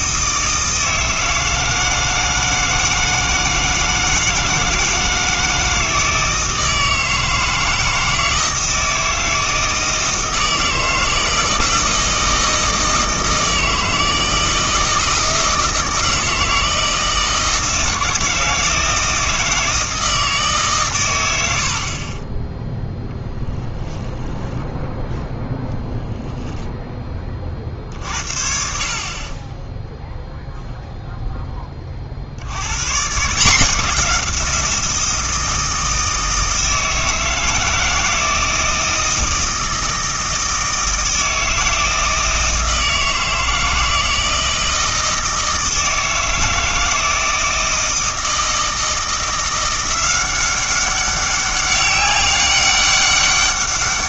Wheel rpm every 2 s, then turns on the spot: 160, 160, 160, 160, 160, 160, 160, 160, 160, 160, 140, 10, 0, 10, 50, 0, 100, 170, 160, 160, 160, 160, 160, 160, 160, 190, 200.
none